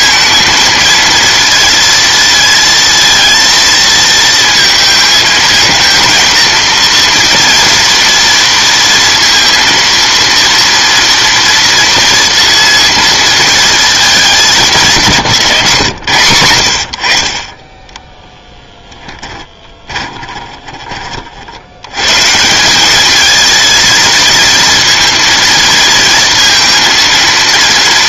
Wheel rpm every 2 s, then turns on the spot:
230, 230, 220, 230, 230, 230, 230, 180, 80, 10, 40, 180, 230, 230.
20-22